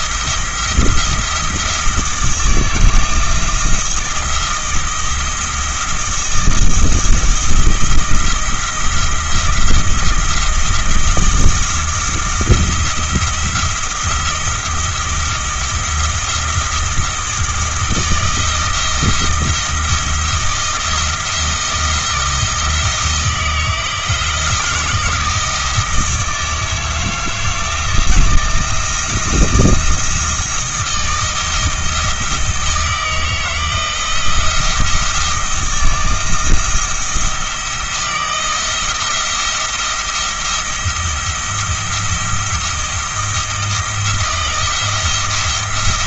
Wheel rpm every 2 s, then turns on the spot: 170, 160, 170, 170, 170, 160, 170, 170, 160, 160, 170, 170, 170, 160, 170, 160, 160, 170, 170, 160, 170, 170, 170.
none